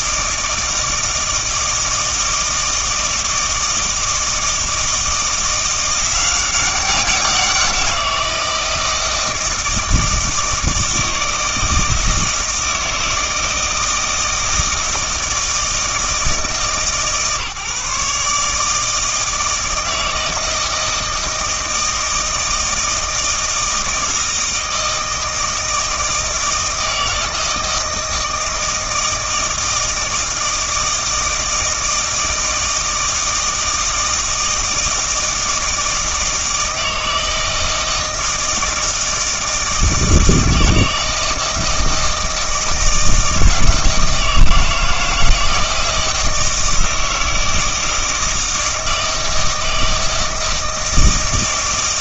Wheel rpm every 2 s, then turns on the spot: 160, 160, 160, 190, 170, 160, 160, 160, 150, 150, 160, 160, 160, 160, 160, 160, 160, 160, 160, 160, 160, 160, 160, 160, 160, 160.
none